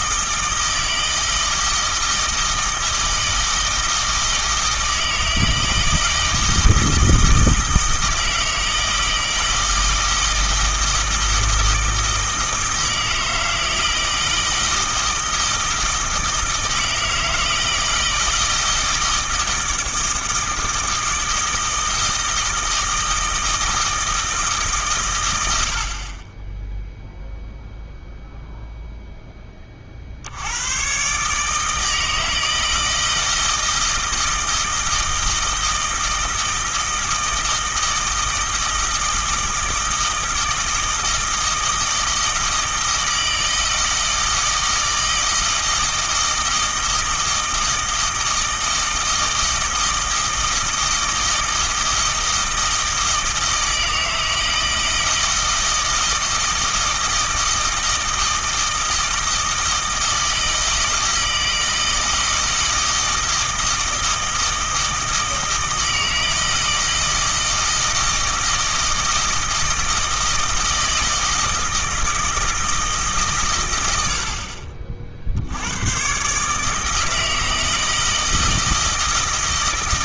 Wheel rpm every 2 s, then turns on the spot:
160, 160, 160, 160, 160, 160, 160, 160, 160, 160, 160, 160, 130, 0, 0, 120, 160, 160, 160, 160, 160, 160, 160, 160, 160, 160, 160, 160, 160, 160, 160, 160, 160, 160, 160, 160, 160, 50, 150, 160.
none